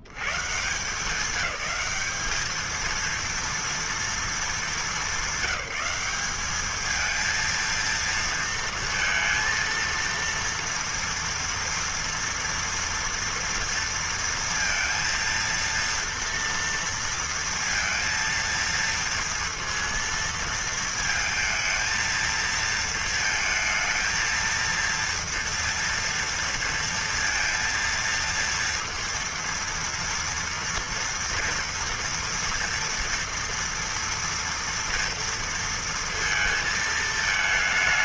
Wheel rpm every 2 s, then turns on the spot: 70, 200, 220, 200, 230, 230, 230, 230, 230, 230, 230, 230, 230, 230, 230, 230, 230, 230, 220.
none